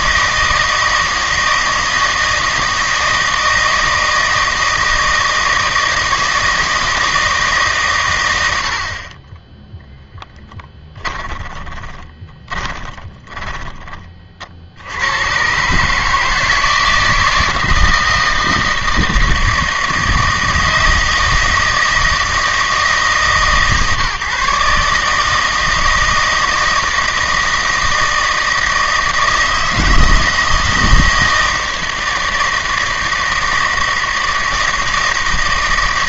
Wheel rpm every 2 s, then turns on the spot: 160, 160, 160, 160, 60, 20, 20, 80, 160, 160, 160, 150, 150, 160, 160, 160, 160, 160.
10-14